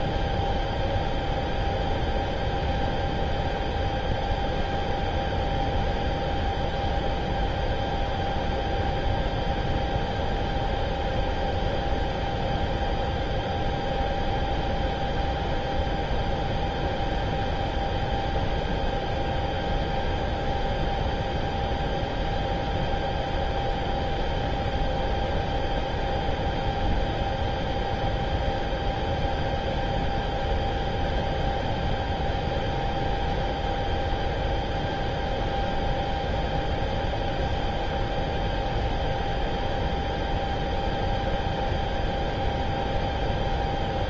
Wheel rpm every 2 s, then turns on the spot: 0, 0, 0, 0, 0, 0, 0, 0, 0, 0, 0, 0, 0, 0, 0, 0, 0, 0, 0, 0, 0, 0.
none